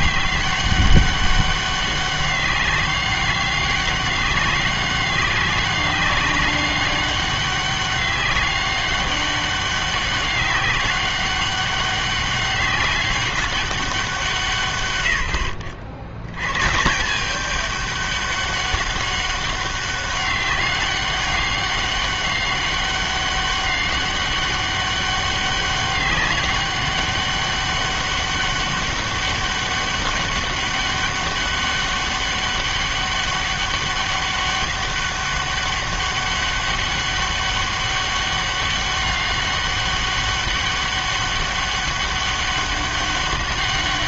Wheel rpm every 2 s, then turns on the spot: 200, 200, 190, 200, 200, 190, 200, 130, 120, 200, 200, 200, 200, 200, 200, 200, 200, 200, 200, 200, 200, 200.
none